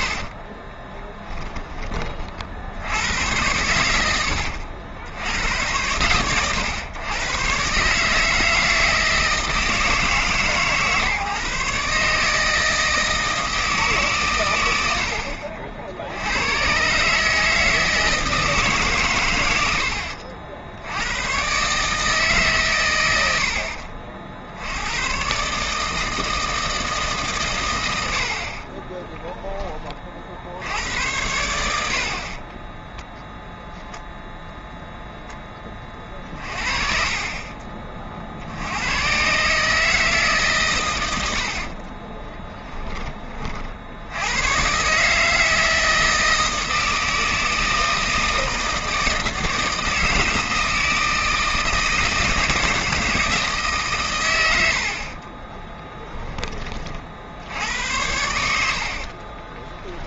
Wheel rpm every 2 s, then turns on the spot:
10, 90, 80, 110, 160, 140, 160, 70, 140, 130, 90, 100, 110, 150, 20, 90, 0, 0, 40, 100, 110, 20, 150, 160, 160, 160, 160, 50, 50, 50.
0-2 28-30 36-38 54-56 58-60